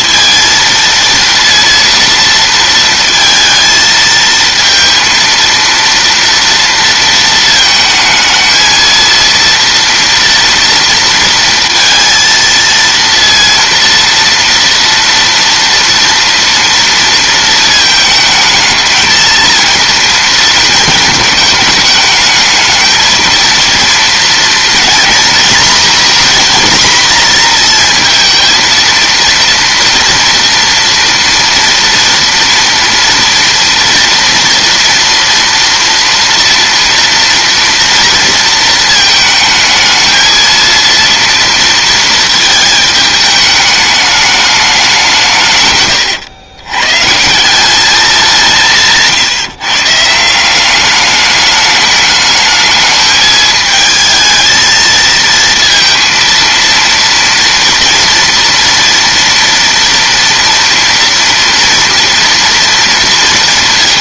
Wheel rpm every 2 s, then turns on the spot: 230, 230, 220, 230, 230, 230, 230, 240, 230, 220, 230, 220, 230, 250, 230, 240, 230, 230, 230, 230, 230, 220, 210, 110, 170, 190, 210, 220, 230, 230, 230, 230.
none